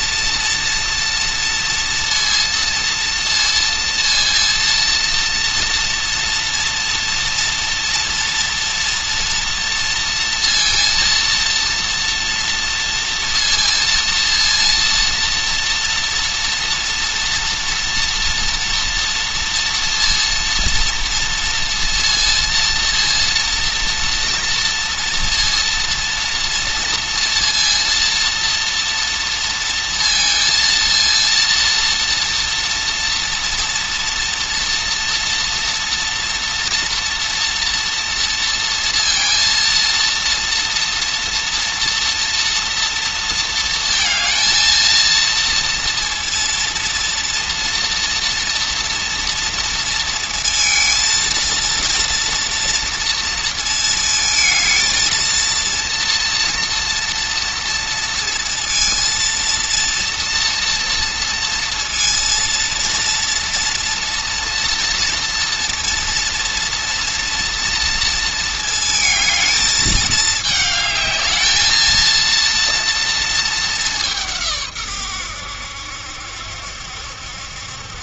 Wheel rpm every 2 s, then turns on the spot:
230, 230, 230, 230, 230, 230, 230, 230, 230, 230, 230, 230, 230, 230, 230, 230, 230, 230, 240, 230, 240, 240, 230, 230, 230, 230, 230, 220, 230, 230, 230, 230, 230, 230, 220, 220, 230, 130, 70.
none